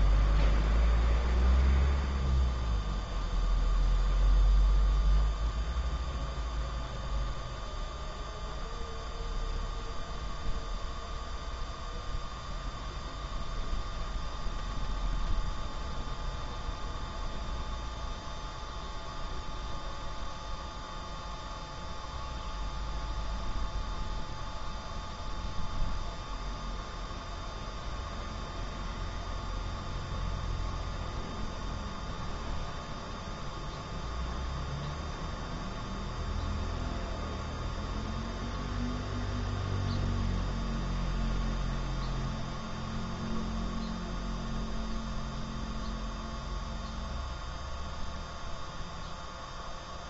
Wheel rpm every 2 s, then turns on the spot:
0, 0, 0, 0, 0, 0, 0, 0, 0, 0, 0, 0, 0, 0, 0, 0, 0, 0, 0, 0, 0, 0, 0, 0, 0.
none